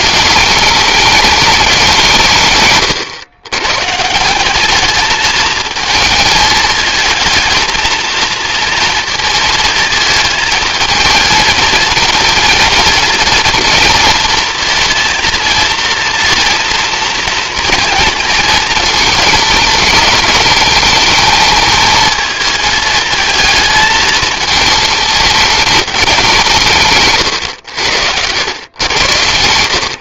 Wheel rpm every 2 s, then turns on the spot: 210, 140, 200, 220, 230, 230, 230, 230, 230, 220, 210, 220, 220, 160, 100.
none